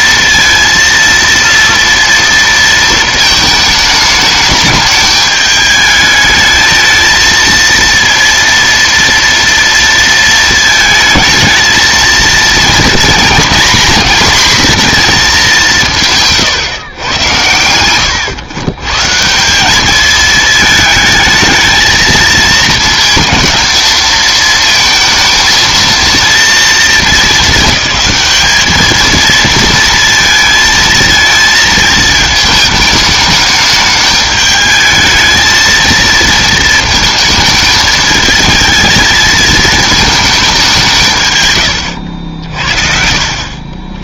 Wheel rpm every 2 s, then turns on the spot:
230, 230, 210, 220, 230, 230, 220, 240, 140, 110, 220, 220, 220, 230, 210, 220, 220, 210, 230, 220, 200, 60.
none